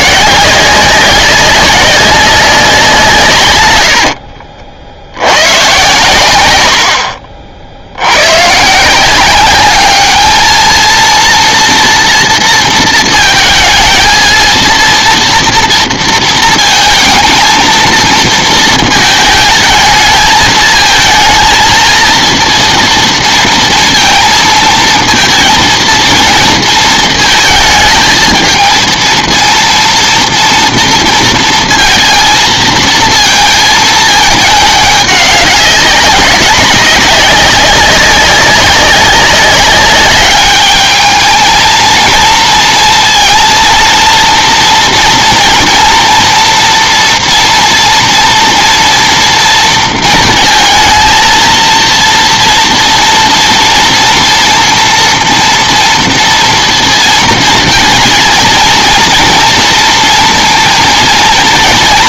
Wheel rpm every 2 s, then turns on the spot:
180, 180, 60, 80, 150, 230, 230, 230, 230, 220, 220, 230, 220, 230, 230, 230, 220, 210, 200, 190, 210, 230, 230, 230, 230, 230, 230, 230, 230, 230, 230.
none